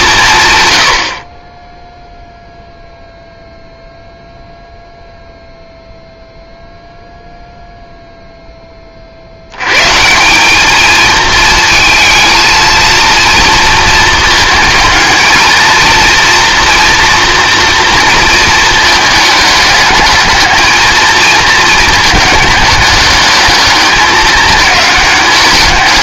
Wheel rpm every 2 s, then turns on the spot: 70, 0, 0, 0, 30, 220, 230, 220, 230, 220, 220, 210, 200.
none